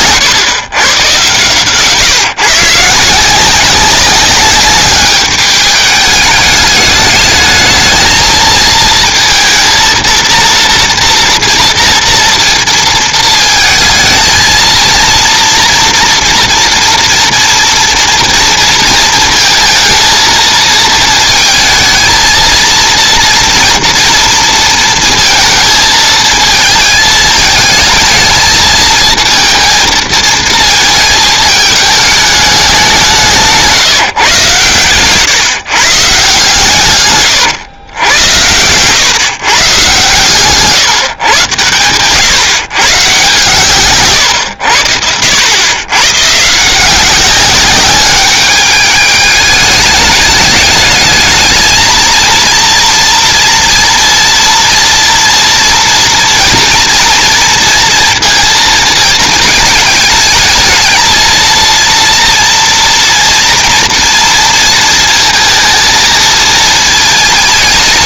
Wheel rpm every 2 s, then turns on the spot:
120, 150, 200, 210, 230, 230, 230, 220, 230, 230, 230, 230, 230, 220, 220, 220, 200, 130, 150, 100, 140, 150, 90, 150, 210, 210, 230, 230, 230, 230, 220, 230, 230, 220.
none